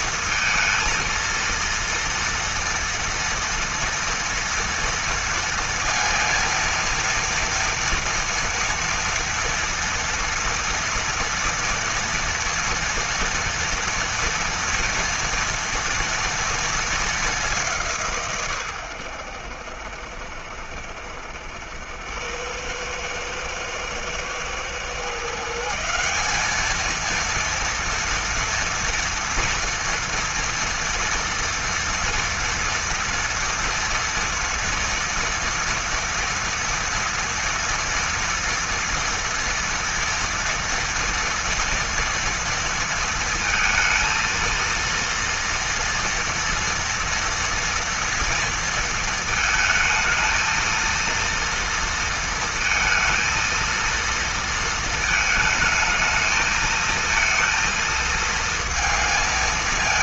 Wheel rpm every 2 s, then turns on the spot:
230, 230, 230, 230, 230, 230, 230, 230, 220, 110, 70, 100, 120, 220, 230, 230, 230, 230, 230, 230, 230, 230, 230, 230, 230, 230, 220, 220, 220, 230.
none